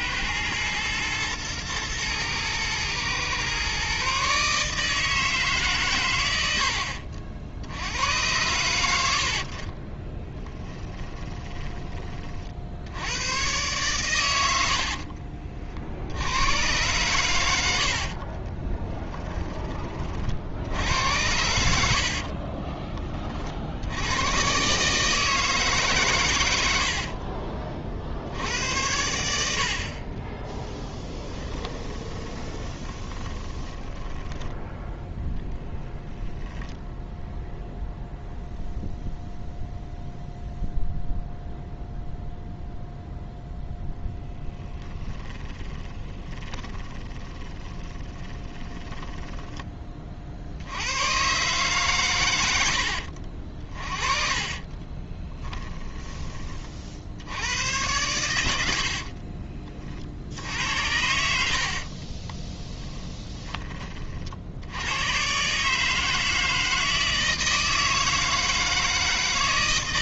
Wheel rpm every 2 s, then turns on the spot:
120, 110, 150, 70, 80, 20, 80, 60, 120, 10, 80, 20, 140, 70, 90, 10, 20, 10, 0, 0, 0, 0, 10, 20, 10, 80, 80, 20, 50, 60, 80, 10, 100, 160, 160.
6-8 10-12 14-16 18-20 26-28 30-34 44-50 54-56 58-60 62-64